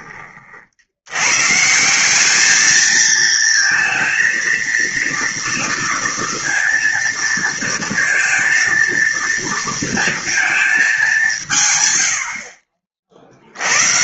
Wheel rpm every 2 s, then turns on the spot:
60, 210, 230, 230, 230, 220, 40.
none